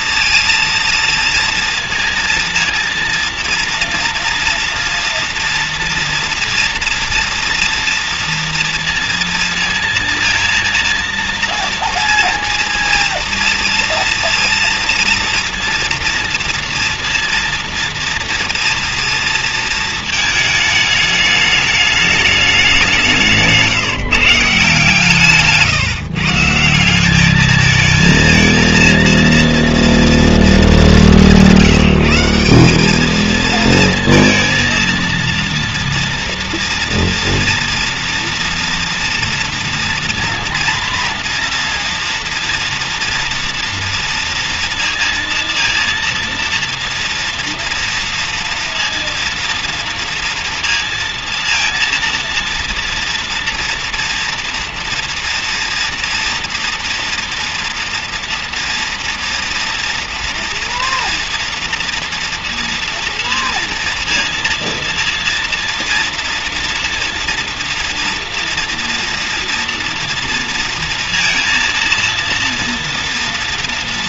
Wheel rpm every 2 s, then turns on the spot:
230, 230, 230, 230, 230, 230, 230, 230, 230, 230, 220, 200, 160, 170, 230, 230, 190, 230, 230, 230, 240, 230, 230, 230, 230, 230, 230, 230, 230, 240, 230, 230, 230, 230, 230, 230, 230.
none